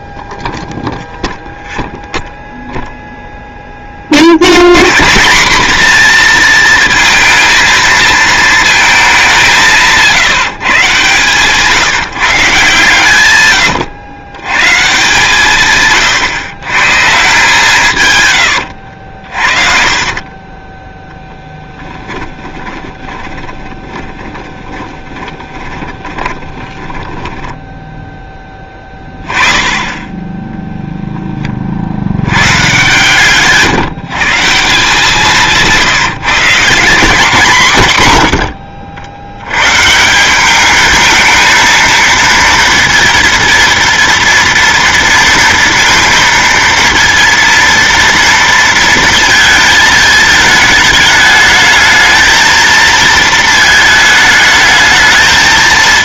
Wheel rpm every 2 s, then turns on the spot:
0, 0, 120, 230, 220, 140, 140, 140, 140, 80, 10, 20, 20, 20, 20, 10, 130, 170, 180, 80, 220, 230, 230, 230, 230, 220, 220, 220.
18-28